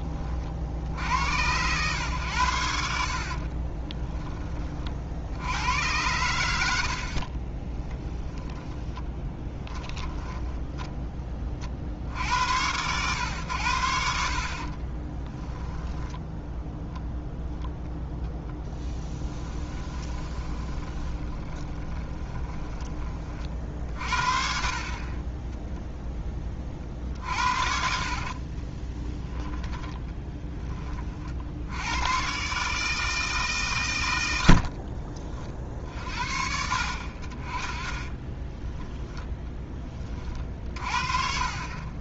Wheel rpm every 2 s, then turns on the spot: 60, 70, 50, 60, 20, 20, 110, 30, 0, 10, 20, 20, 40, 40, 20, 30, 150, 50, 60, 10, 50.
8-12 14-16 18-22 28-30 34-36 38-40